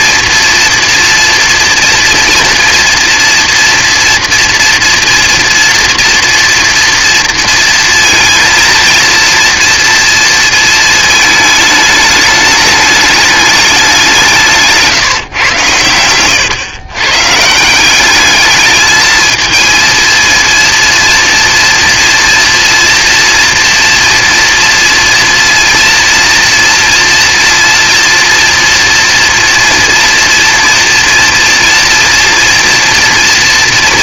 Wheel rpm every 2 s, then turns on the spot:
230, 230, 230, 240, 230, 230, 210, 170, 130, 210, 230, 230, 230, 230, 240, 230, 230.
none